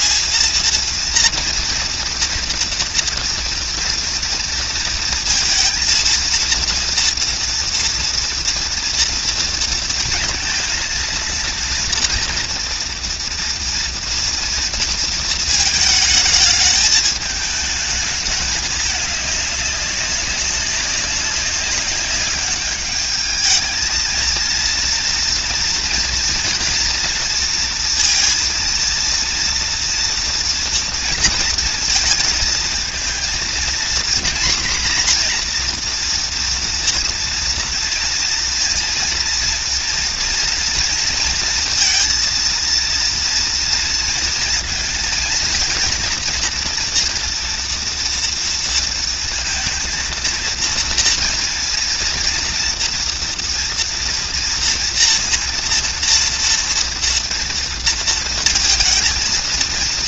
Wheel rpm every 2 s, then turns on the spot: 230, 230, 230, 230, 230, 230, 230, 230, 220, 210, 190, 210, 230, 230, 230, 230, 230, 250, 240, 230, 230, 230, 230, 240, 230, 230, 230, 230, 230, 230.
none